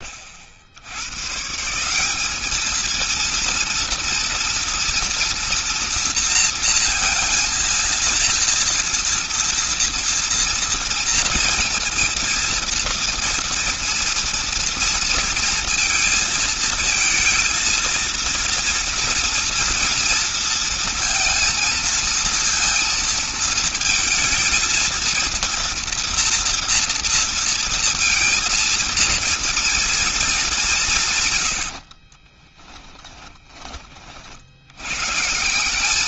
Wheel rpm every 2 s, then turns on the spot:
100, 230, 230, 230, 230, 230, 230, 230, 230, 230, 230, 230, 230, 230, 230, 150, 10, 130.
30-32